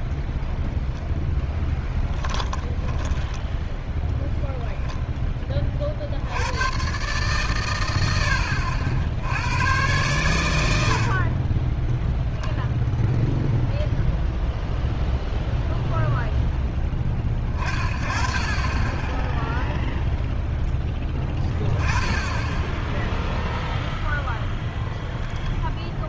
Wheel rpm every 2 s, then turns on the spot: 0, 10, 10, 130, 80, 70, 0, 0, 10, 10, 0, 10, 10.
2-4